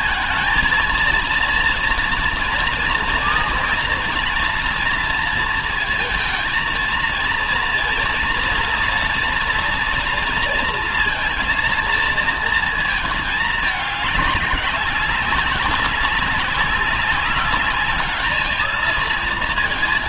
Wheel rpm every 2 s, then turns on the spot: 220, 230, 230, 230, 230, 230, 230, 190, 190, 210.
none